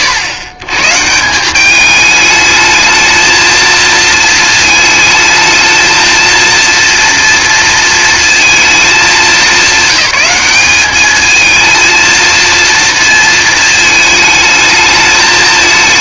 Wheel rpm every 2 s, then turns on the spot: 100, 220, 220, 230, 210, 200, 230, 220.
none